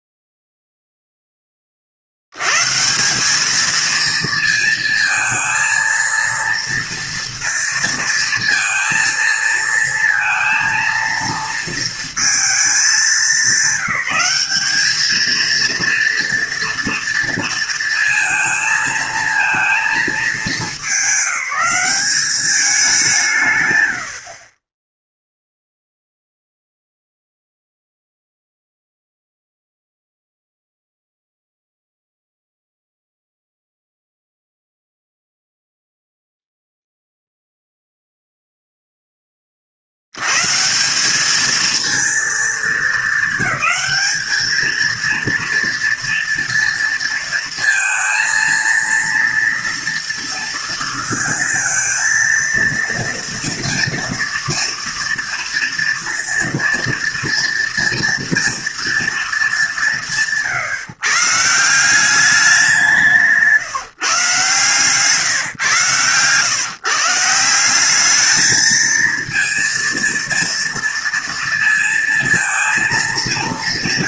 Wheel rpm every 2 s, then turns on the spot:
0, 120, 230, 230, 230, 230, 220, 200, 230, 230, 210, 200, 20, 0, 0, 0, 0, 0, 0, 0, 160, 220, 220, 230, 230, 230, 230, 240, 230, 230, 150, 190, 140, 130, 220, 230, 220.
none